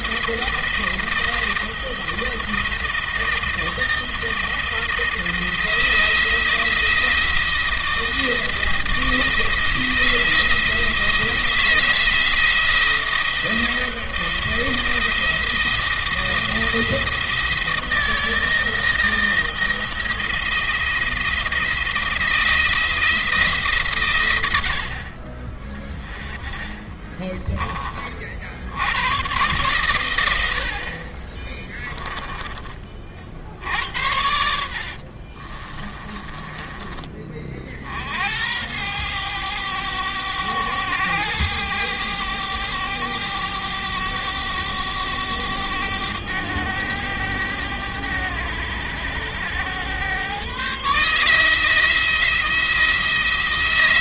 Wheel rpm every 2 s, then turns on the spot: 170, 170, 170, 170, 160, 160, 160, 160, 170, 160, 170, 160, 50, 20, 100, 60, 40, 50, 20, 90, 100, 100, 100, 100, 100, 140, 170.
26-28 34-36